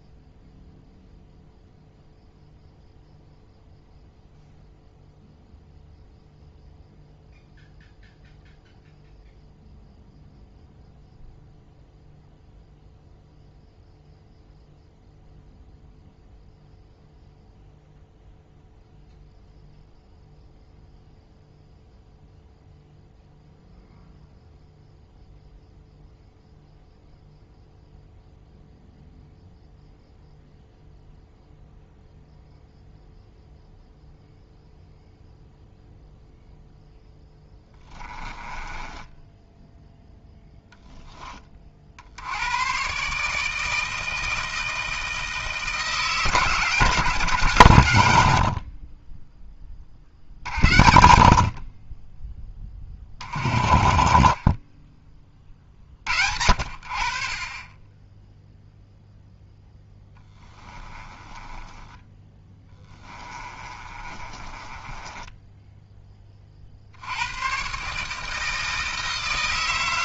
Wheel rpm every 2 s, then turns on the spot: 0, 0, 0, 0, 0, 0, 0, 0, 0, 0, 0, 0, 0, 0, 0, 0, 0, 0, 0, 10, 0, 110, 160, 170, 60, 60, 20, 30, 60, 0, 10, 20, 20, 40, 160.
38-40 60-66